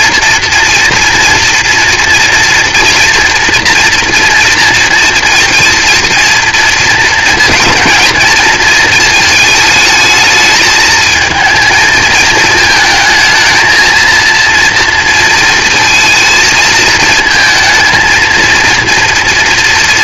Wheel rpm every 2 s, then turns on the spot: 230, 230, 230, 230, 220, 220, 220, 230, 220, 230.
none